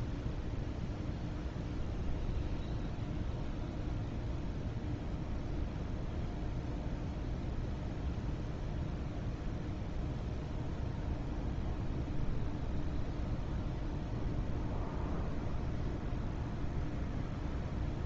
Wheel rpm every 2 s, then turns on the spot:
0, 0, 0, 0, 0, 0, 0, 0, 0.
none